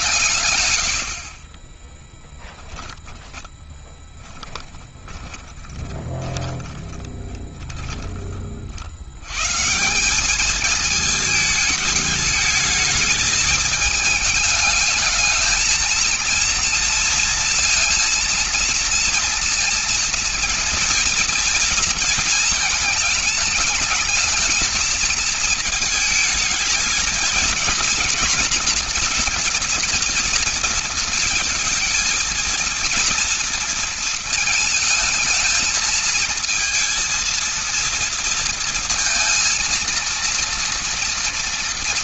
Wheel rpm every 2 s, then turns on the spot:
110, 20, 10, 20, 50, 210, 220, 220, 230, 230, 230, 220, 220, 220, 230, 230, 230, 220, 230, 230, 230.
2-8